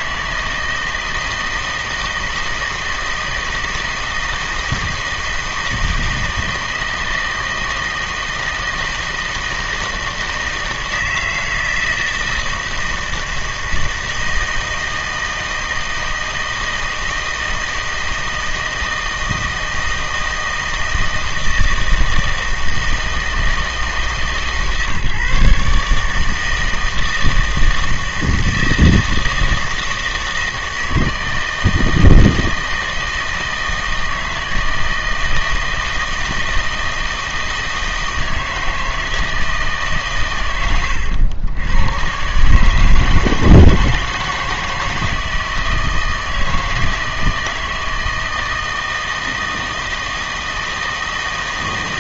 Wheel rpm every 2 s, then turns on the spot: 160, 160, 160, 160, 160, 160, 160, 160, 160, 160, 160, 160, 140, 160, 160, 160, 160, 160, 160, 160, 100, 150, 160, 160, 160, 160.
none